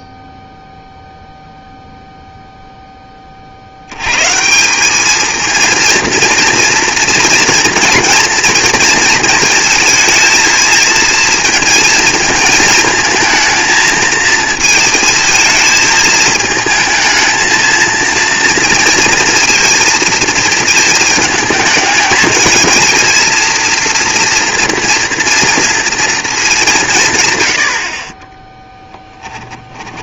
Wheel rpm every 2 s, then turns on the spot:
0, 0, 170, 230, 230, 220, 220, 220, 220, 230, 230, 230, 240, 180, 10.
28-30